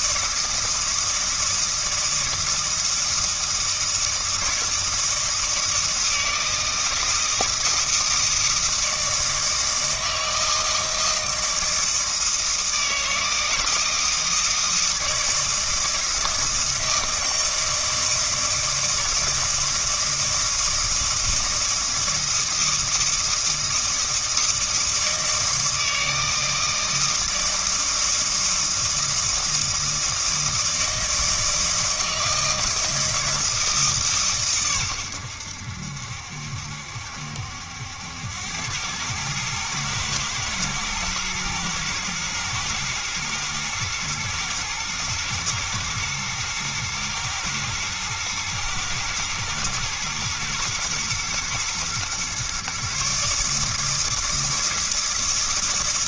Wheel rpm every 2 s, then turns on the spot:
160, 160, 160, 160, 160, 160, 160, 160, 160, 160, 160, 160, 160, 160, 160, 160, 160, 120, 70, 100, 110, 120, 110, 110, 110, 110, 140, 160.
none